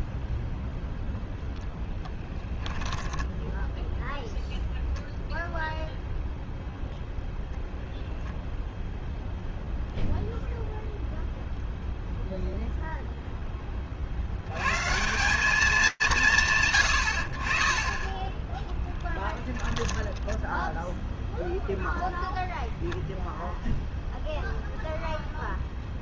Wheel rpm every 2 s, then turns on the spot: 0, 10, 0, 10, 0, 0, 70, 160, 10, 20, 0, 0, 0.
2-4 18-20